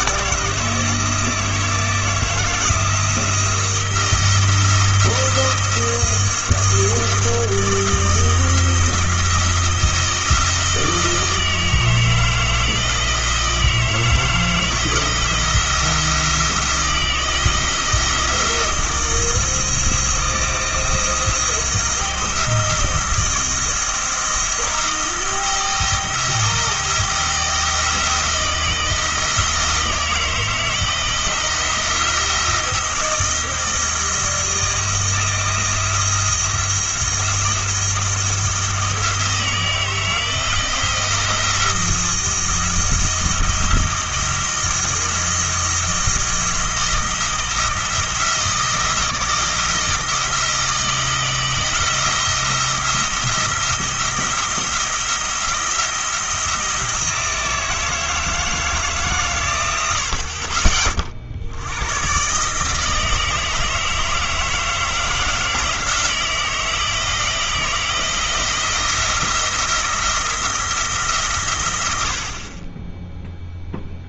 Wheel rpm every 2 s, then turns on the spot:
160, 170, 170, 170, 170, 160, 160, 160, 170, 170, 160, 170, 170, 160, 160, 160, 170, 170, 170, 170, 160, 170, 170, 170, 160, 170, 170, 170, 170, 160, 40, 150, 160, 160, 170, 170, 30.
none